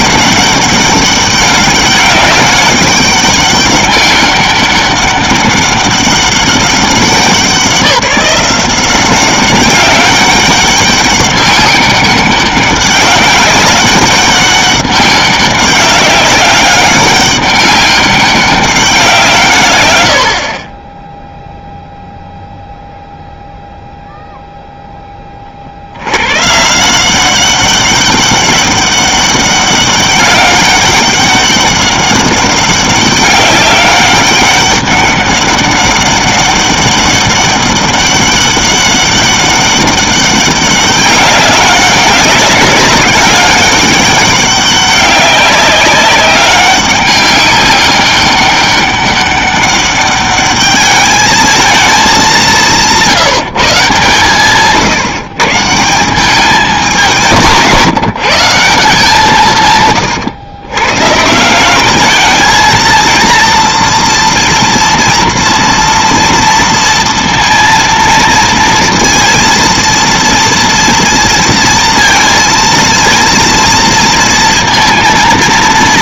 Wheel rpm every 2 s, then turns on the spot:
200, 200, 200, 190, 180, 200, 200, 200, 200, 190, 40, 0, 0, 140, 200, 200, 200, 200, 200, 200, 200, 200, 200, 200, 200, 210, 180, 140, 190, 160, 120, 220, 230, 230, 230, 230, 230, 230.
none